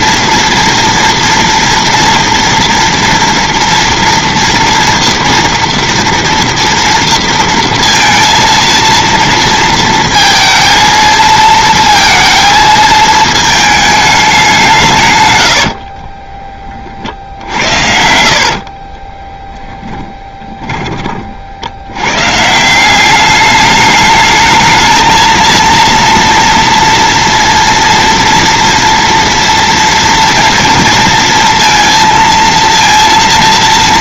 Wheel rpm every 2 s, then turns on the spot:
230, 230, 230, 230, 230, 230, 220, 150, 40, 40, 30, 180, 220, 240, 230, 230, 230.
18-20